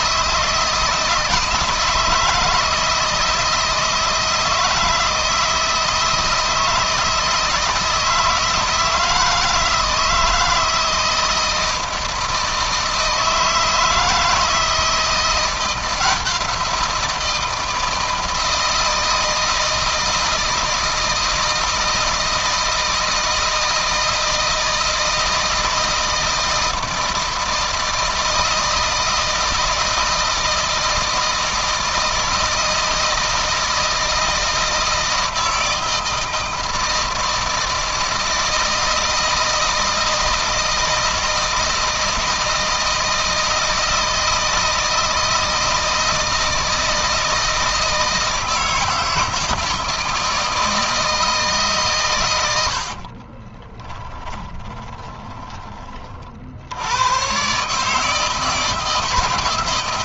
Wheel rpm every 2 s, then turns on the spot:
160, 160, 160, 160, 160, 160, 160, 170, 170, 160, 160, 160, 160, 160, 160, 160, 160, 160, 160, 160, 160, 160, 160, 160, 160, 160, 60, 20, 80, 160.
52-56